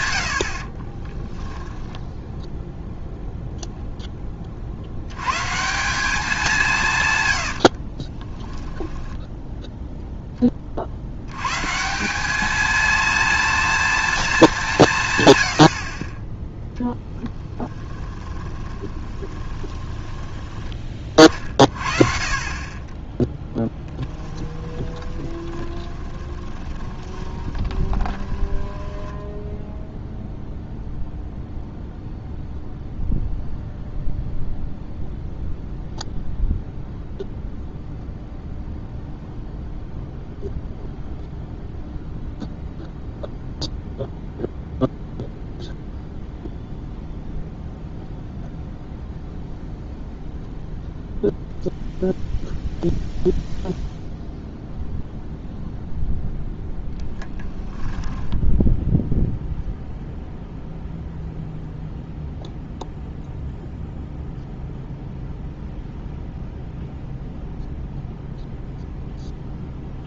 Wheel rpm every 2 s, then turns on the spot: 40, 0, 80, 160, 10, 50, 230, 160, 10, 20, 20, 20, 20, 20, 10, 0, 0, 0, 0, 0, 0, 0, 0, 0, 0, 0, 0, 0, 10, 0, 0, 0, 0, 0, 0.
0-2 8-10 18-20 24-30 56-58